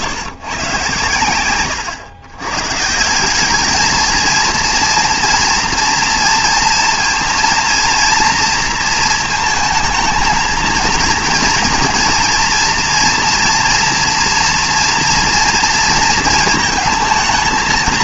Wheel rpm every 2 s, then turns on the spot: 140, 120, 230, 230, 230, 230, 230, 230, 230.
none